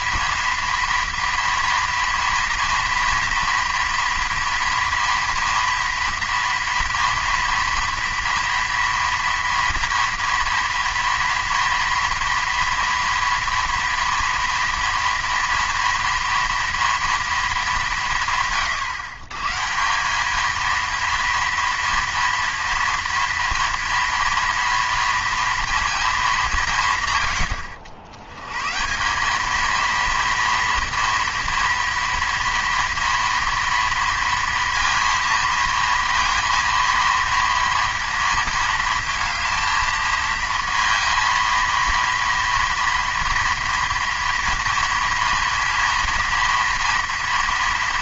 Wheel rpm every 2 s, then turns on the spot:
230, 230, 230, 230, 230, 230, 240, 230, 230, 140, 230, 230, 230, 160, 130, 230, 230, 230, 230, 230, 230, 230, 230, 230.
none